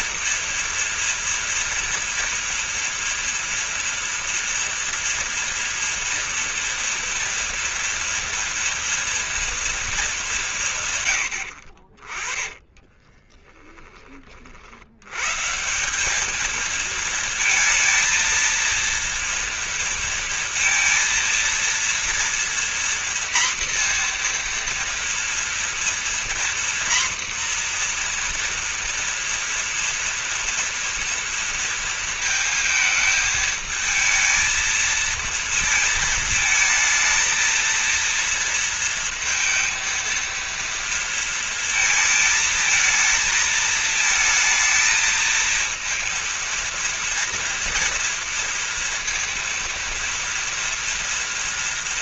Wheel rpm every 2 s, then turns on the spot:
230, 240, 230, 230, 230, 160, 20, 70, 220, 230, 230, 240, 240, 240, 230, 230, 220, 230, 220, 230, 230, 220, 230, 230, 230, 230.
12-14